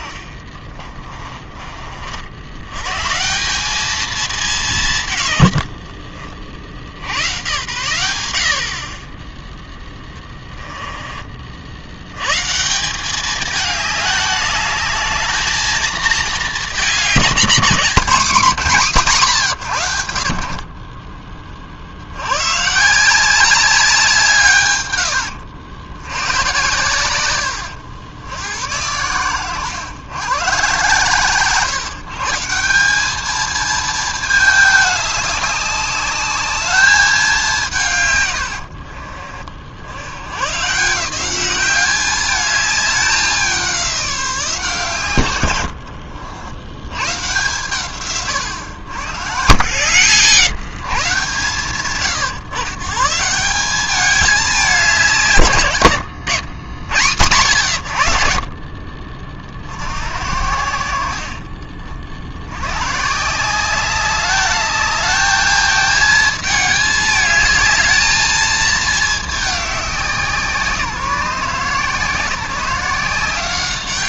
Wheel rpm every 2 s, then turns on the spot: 30, 90, 180, 60, 60, 20, 160, 210, 210, 200, 50, 150, 130, 100, 90, 120, 170, 210, 210, 90, 140, 210, 160, 90, 110, 160, 140, 210, 110, 50, 70, 110, 210, 220, 220, 170, 170.
0-2 10-12